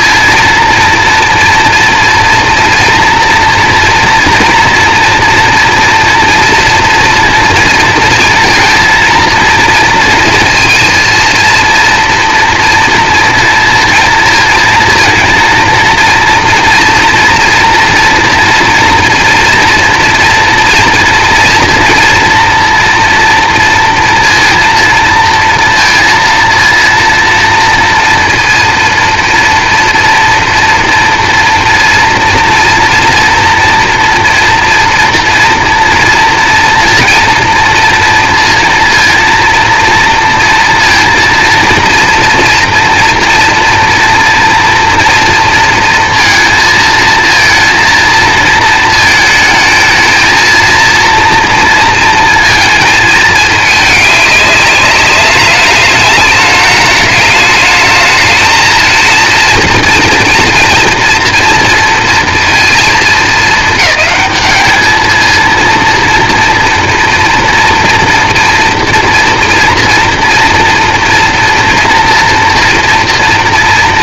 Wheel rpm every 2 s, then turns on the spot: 230, 230, 230, 230, 230, 230, 230, 230, 230, 230, 230, 230, 230, 230, 230, 230, 230, 240, 230, 230, 230, 240, 230, 230, 220, 230, 220, 200, 210, 230, 230, 220, 220, 230, 240, 230, 240.
none